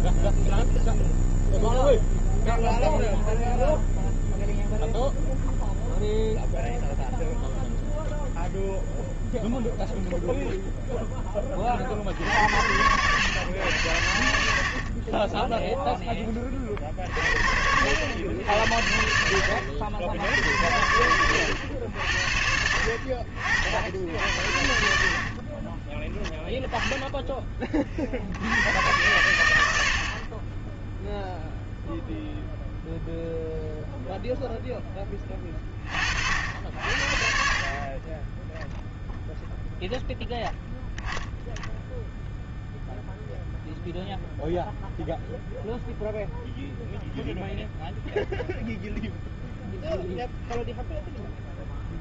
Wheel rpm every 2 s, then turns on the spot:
0, 0, 0, 0, 0, 0, 100, 50, 30, 80, 80, 60, 70, 10, 90, 30, 0, 0, 60, 10, 0, 0, 0, 0, 0, 0.
none